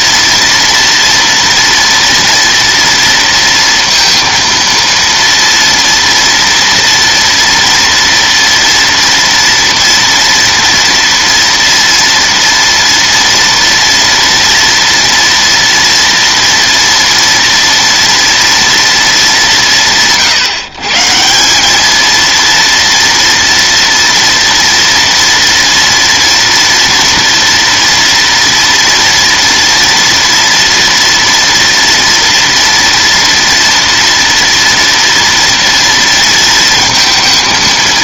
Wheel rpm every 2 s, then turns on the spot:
230, 230, 230, 230, 230, 230, 230, 230, 230, 230, 150, 230, 230, 230, 230, 240, 230, 230, 220.
none